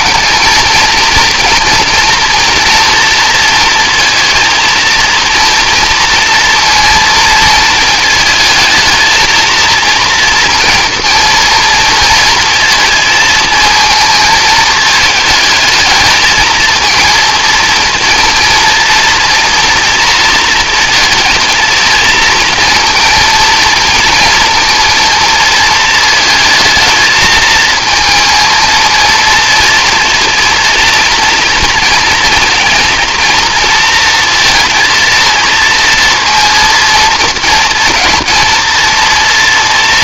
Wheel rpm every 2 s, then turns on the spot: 230, 230, 230, 230, 230, 230, 230, 220, 220, 230, 230, 230, 230, 220, 230, 230, 230, 230, 230, 230.
none